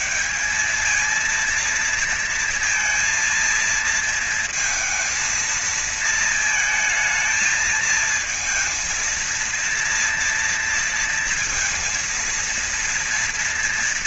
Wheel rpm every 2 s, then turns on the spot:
170, 230, 230, 230, 230, 230, 230.
none